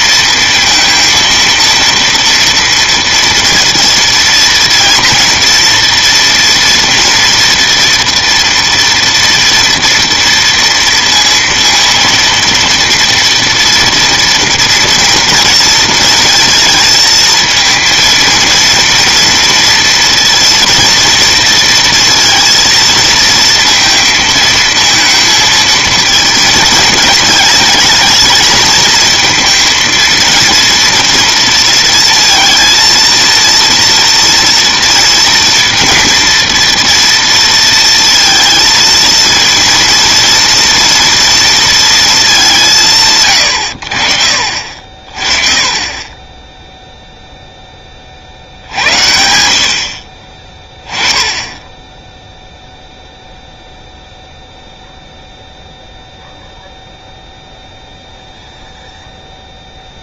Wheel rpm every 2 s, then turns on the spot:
230, 230, 230, 230, 230, 230, 230, 230, 220, 230, 230, 230, 220, 220, 220, 230, 230, 230, 230, 230, 230, 190, 50, 10, 70, 20, 0, 0, 0, 0.
none